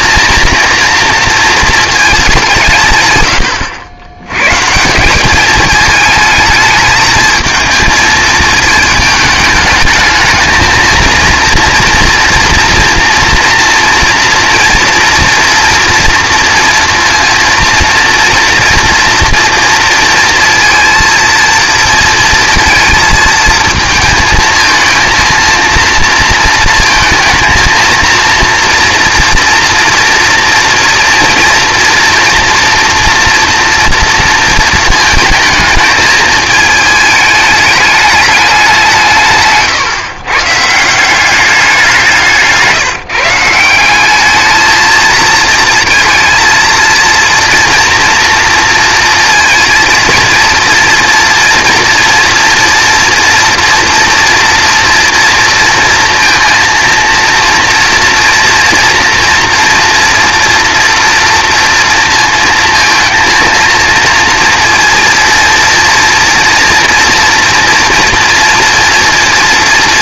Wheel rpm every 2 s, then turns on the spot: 230, 170, 140, 220, 220, 220, 240, 230, 240, 230, 230, 230, 220, 230, 230, 230, 230, 230, 220, 200, 150, 170, 220, 230, 230, 230, 240, 230, 230, 230, 230, 230, 230, 230, 230.
none